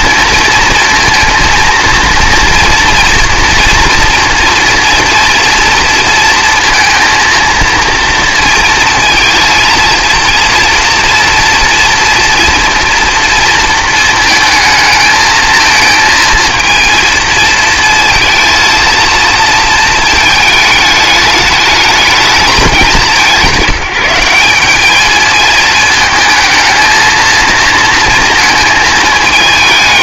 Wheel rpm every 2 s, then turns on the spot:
230, 230, 240, 230, 230, 230, 230, 220, 220, 230, 220, 210, 190, 220, 220.
none